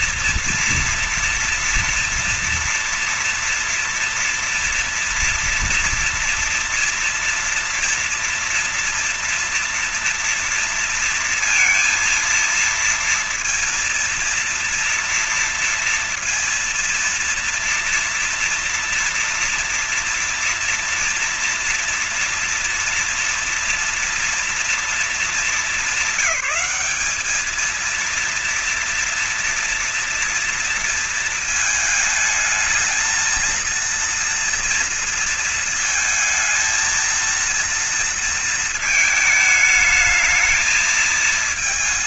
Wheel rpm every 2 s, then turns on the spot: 230, 230, 230, 230, 240, 230, 230, 230, 230, 230, 230, 240, 230, 210, 210, 230, 230, 230, 230, 230, 210.
none